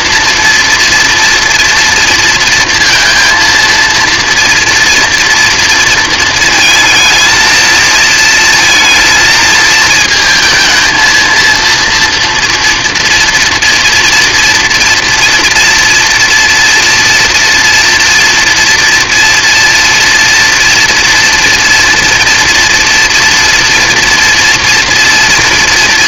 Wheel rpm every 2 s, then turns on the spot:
230, 230, 240, 230, 230, 230, 230, 230, 240, 230, 230, 230, 230.
none